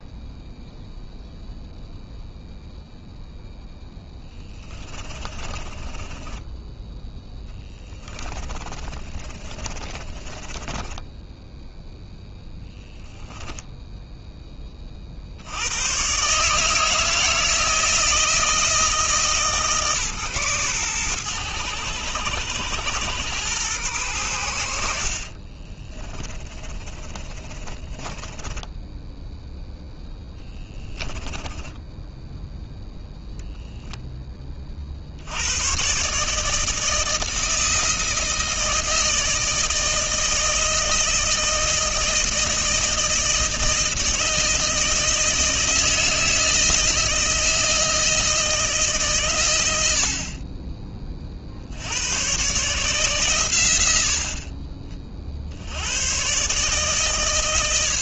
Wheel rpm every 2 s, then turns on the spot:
0, 0, 30, 10, 30, 10, 0, 50, 160, 160, 110, 100, 70, 30, 10, 10, 0, 60, 160, 160, 160, 160, 160, 160, 140, 30, 140, 40, 150.
4-6 8-12 26-32